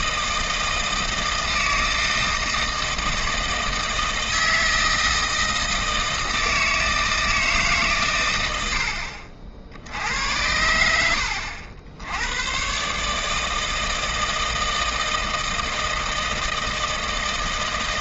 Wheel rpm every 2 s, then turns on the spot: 160, 160, 160, 160, 90, 90, 120, 160, 160.
none